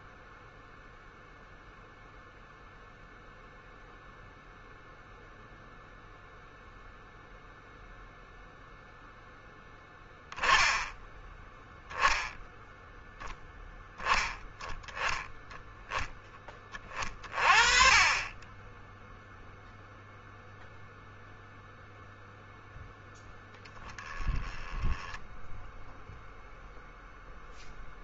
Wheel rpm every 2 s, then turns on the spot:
0, 0, 0, 0, 0, 10, 0, 10, 20, 10, 0, 0, 10, 0.
24-26